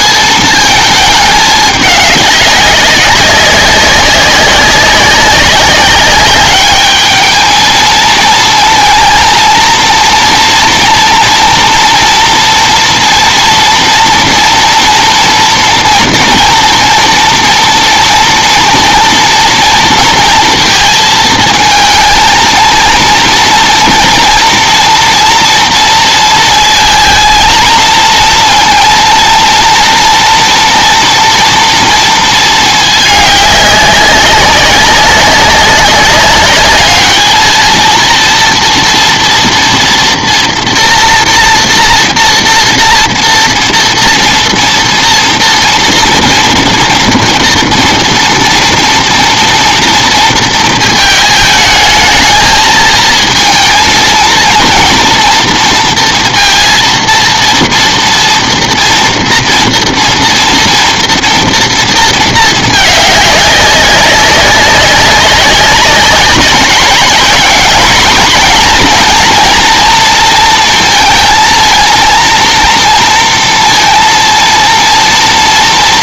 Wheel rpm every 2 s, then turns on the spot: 220, 200, 190, 210, 230, 230, 240, 240, 230, 230, 220, 230, 230, 230, 230, 240, 220, 190, 210, 230, 230, 230, 230, 230, 230, 230, 220, 230, 230, 230, 230, 220, 200, 200, 240, 230, 230, 230.
none